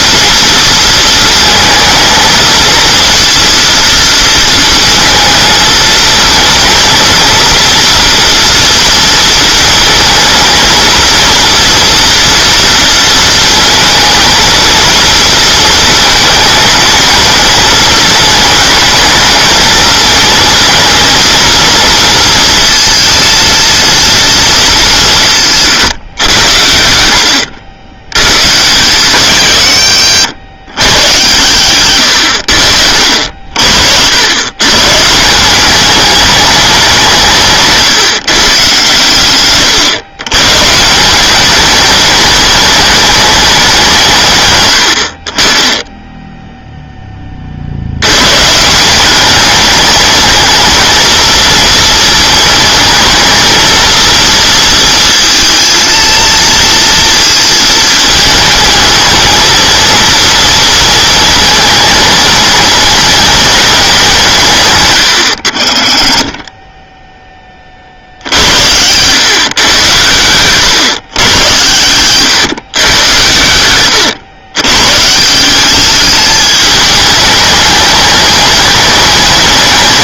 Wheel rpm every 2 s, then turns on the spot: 230, 230, 230, 230, 230, 220, 230, 230, 220, 220, 220, 230, 210, 80, 130, 100, 70, 120, 190, 130, 140, 210, 100, 0, 160, 220, 220, 230, 230, 220, 230, 220, 140, 20, 80, 130, 110, 110, 210, 210.
none